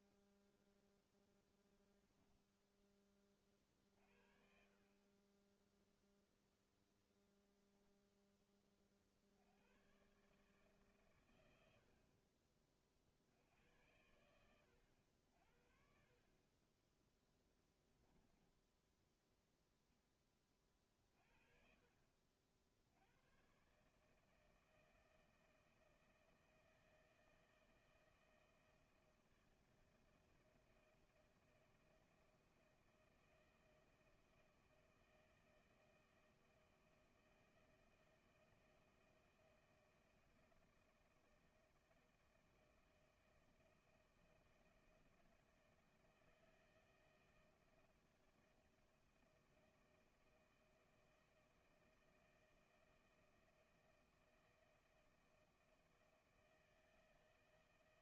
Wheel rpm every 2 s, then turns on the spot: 10, 50, 0, 0, 130, 60, 90, 50, 10, 10, 40, 130, 160, 160, 160, 160, 160, 160, 160, 160, 160, 160, 160, 160, 160, 160, 160, 160, 160.
0-2 14-16